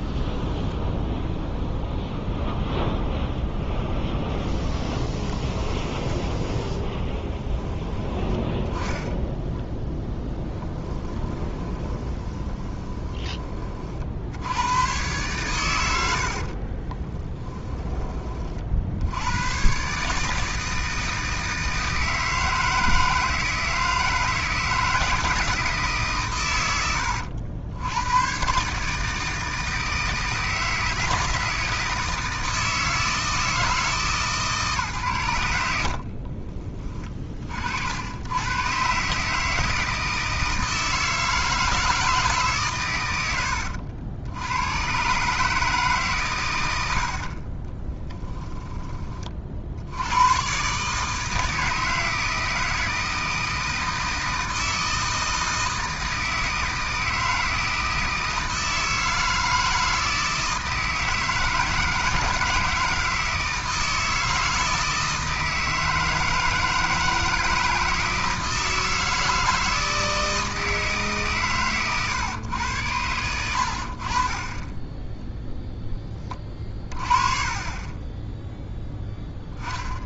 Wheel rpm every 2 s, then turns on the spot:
10, 0, 0, 10, 10, 10, 20, 100, 40, 60, 160, 160, 160, 100, 140, 160, 160, 130, 20, 130, 160, 130, 120, 80, 20, 140, 160, 160, 160, 160, 160, 160, 160, 160, 160, 160, 110, 20, 30, 0.
0-2 10-14 16-18 48-50